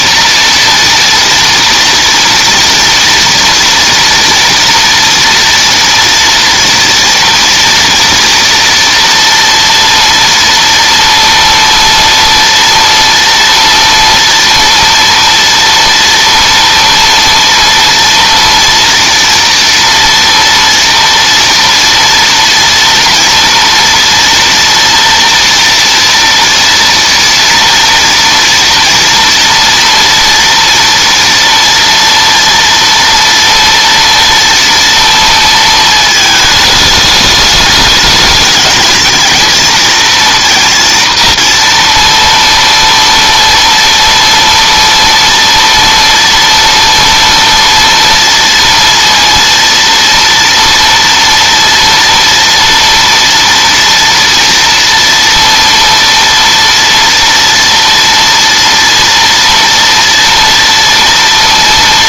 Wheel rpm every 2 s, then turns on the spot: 230, 230, 230, 230, 230, 230, 230, 230, 230, 230, 230, 230, 230, 230, 230, 230, 230, 230, 210, 210, 230, 230, 230, 230, 230, 230, 230, 230, 230, 230, 230.
none